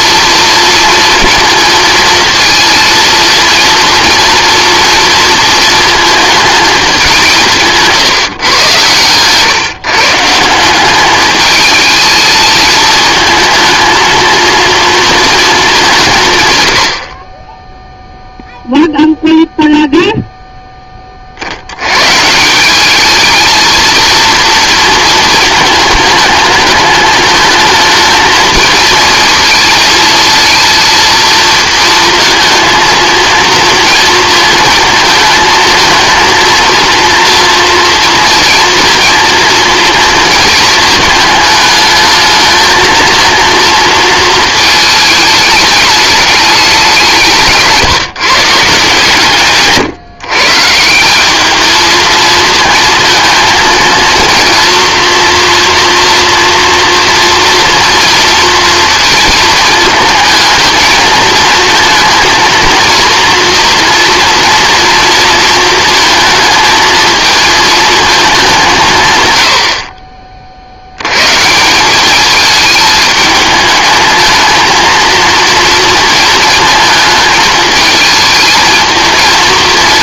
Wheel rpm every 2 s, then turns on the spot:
230, 230, 230, 220, 120, 190, 220, 230, 100, 0, 10, 190, 230, 210, 220, 230, 230, 220, 230, 230, 220, 220, 220, 190, 160, 160, 230, 230, 230, 230, 220, 230, 230, 220, 170, 60, 210, 230, 220, 220.
none